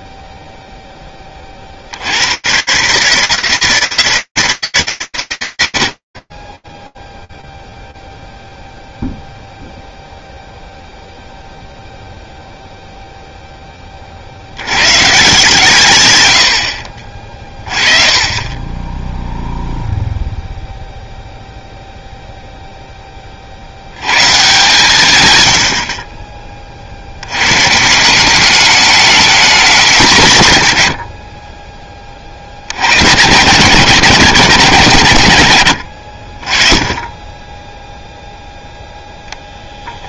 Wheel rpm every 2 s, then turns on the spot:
0, 60, 160, 30, 0, 0, 0, 140, 40, 0, 0, 20, 130, 90, 210, 50, 130, 90, 20, 0.
none